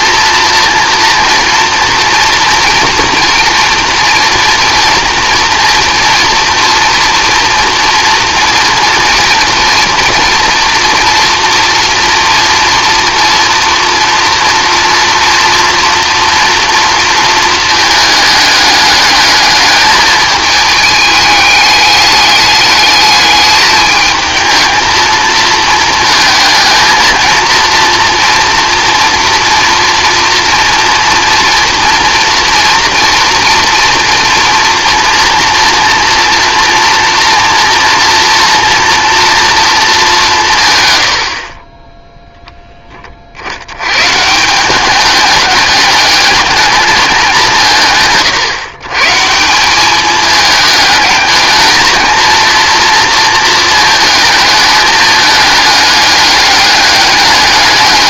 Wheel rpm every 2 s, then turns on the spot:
240, 240, 240, 230, 230, 230, 230, 240, 230, 210, 210, 210, 220, 230, 230, 240, 230, 230, 230, 230, 130, 20, 200, 210, 140, 210, 230, 210, 210.
none